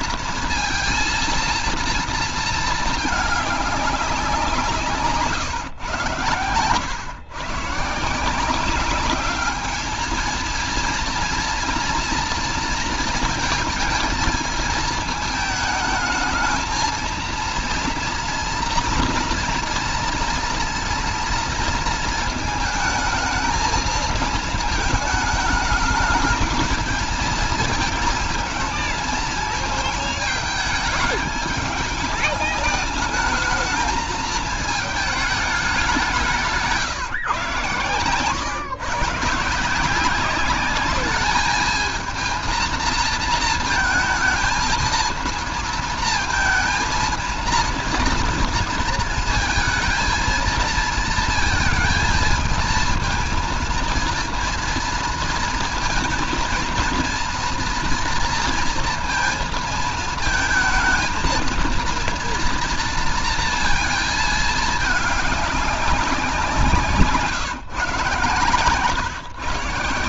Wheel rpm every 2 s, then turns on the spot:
230, 230, 180, 100, 180, 230, 230, 220, 220, 230, 230, 220, 220, 220, 220, 220, 210, 220, 170, 130, 200, 230, 220, 230, 230, 220, 230, 230, 230, 230, 220, 230, 210, 180, 150.
66-68